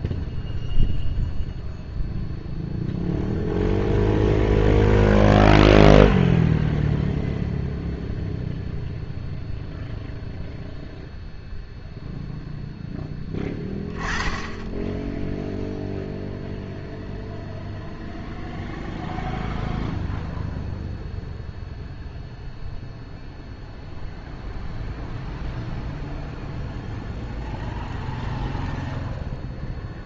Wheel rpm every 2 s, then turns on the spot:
0, 0, 0, 0, 0, 0, 10, 0, 0, 0, 0, 0, 0, 0, 0.
none